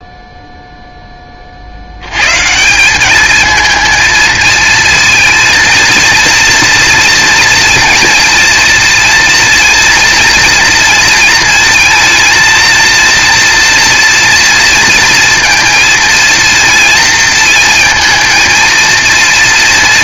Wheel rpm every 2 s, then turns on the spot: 10, 190, 230, 230, 230, 230, 230, 230, 230, 230.
none